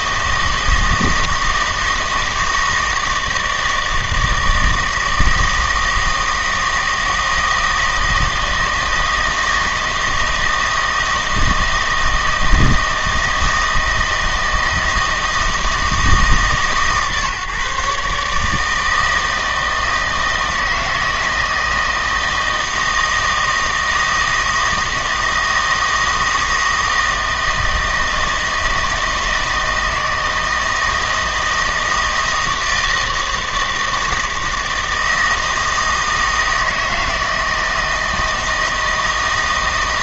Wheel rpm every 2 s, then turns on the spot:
160, 160, 160, 160, 160, 160, 160, 160, 140, 160, 160, 160, 160, 160, 160, 160, 160, 160, 160, 160.
none